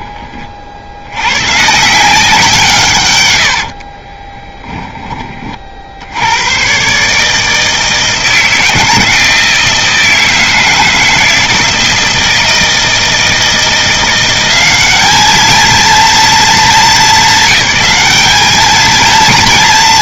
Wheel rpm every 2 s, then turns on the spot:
70, 150, 10, 130, 160, 160, 160, 200, 200, 230.
none